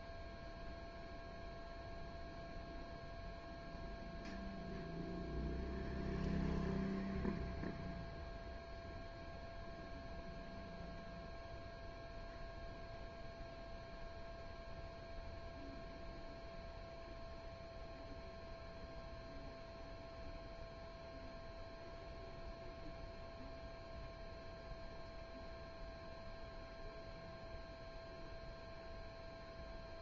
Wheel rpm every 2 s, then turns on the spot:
0, 0, 0, 0, 0, 0, 0, 0, 0, 0, 0, 0, 0, 0, 0.
none